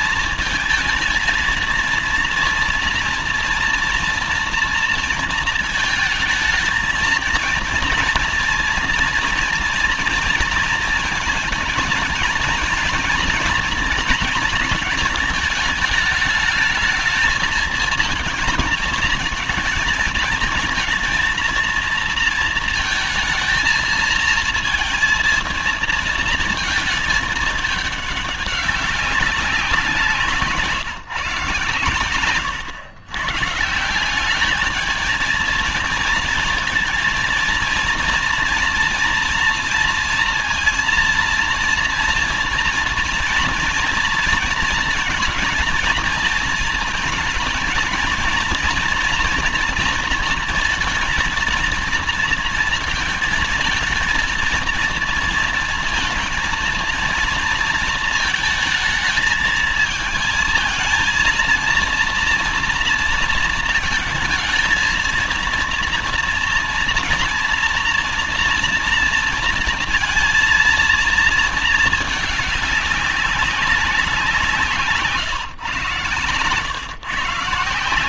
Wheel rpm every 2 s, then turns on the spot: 220, 230, 230, 220, 230, 230, 240, 240, 210, 220, 230, 230, 230, 230, 200, 160, 120, 200, 230, 230, 230, 230, 230, 220, 230, 230, 230, 230, 230, 220, 220, 230, 220, 240, 240, 230, 210, 170, 120.
none